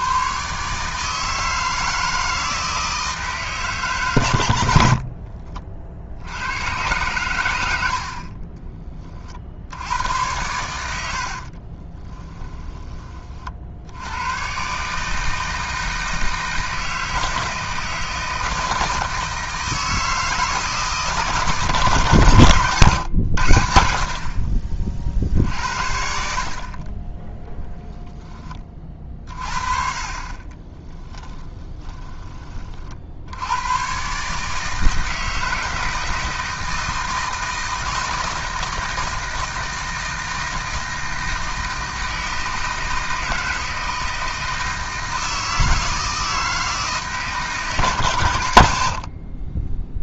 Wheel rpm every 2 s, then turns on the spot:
130, 160, 100, 90, 40, 90, 10, 110, 160, 160, 160, 130, 40, 60, 20, 40, 30, 150, 160, 160, 160, 160, 160, 160, 100.
12-14 30-32